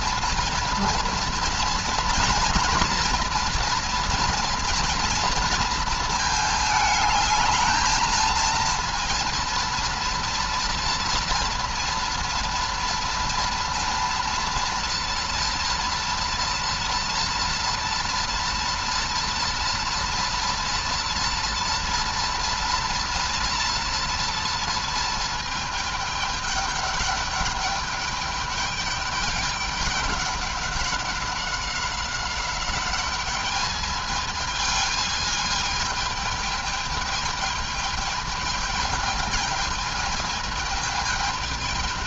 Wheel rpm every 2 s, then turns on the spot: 230, 230, 230, 220, 230, 230, 230, 230, 230, 230, 230, 230, 230, 210, 210, 200, 190, 220, 220, 220, 220.
none